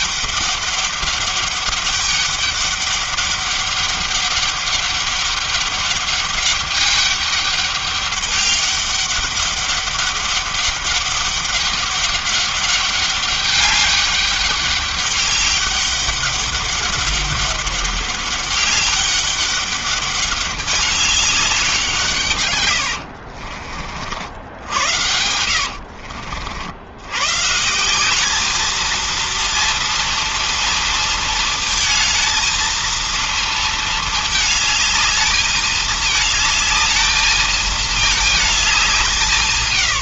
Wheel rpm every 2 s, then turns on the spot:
200, 200, 200, 200, 200, 200, 200, 200, 200, 200, 200, 120, 80, 70, 210, 230, 230, 220, 220, 210.
22-26